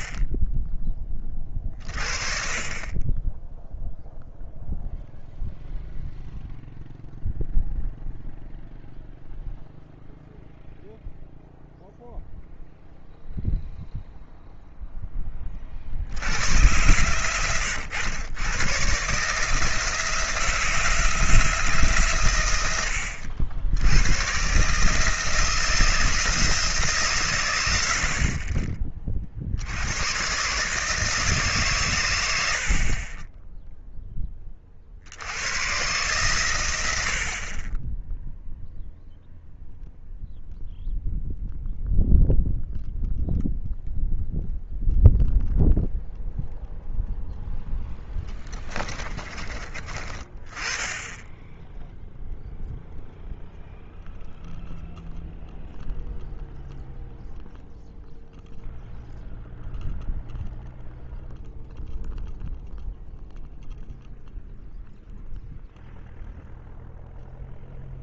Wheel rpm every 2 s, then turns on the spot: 20, 30, 0, 0, 0, 0, 0, 10, 110, 130, 170, 80, 150, 150, 30, 150, 40, 50, 90, 0, 0, 0, 0, 0, 20, 10, 0, 0, 0, 0, 0, 0, 0, 0.
48-50